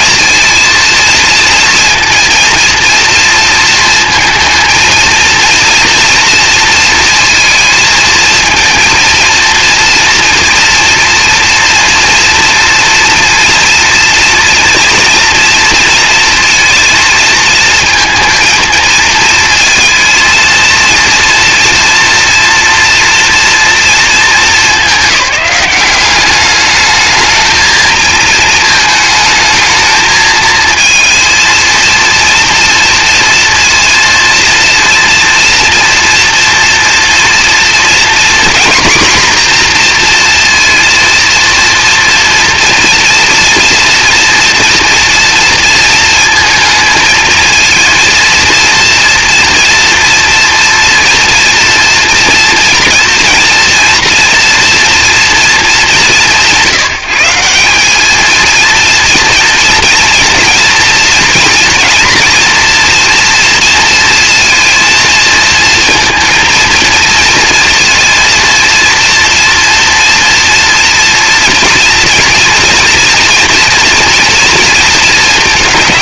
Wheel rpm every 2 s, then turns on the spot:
230, 230, 220, 230, 230, 230, 230, 230, 230, 230, 230, 240, 210, 210, 220, 230, 230, 230, 230, 250, 230, 240, 240, 230, 240, 230, 230, 230, 160, 230, 230, 230, 230, 230, 230, 230, 230, 230.
none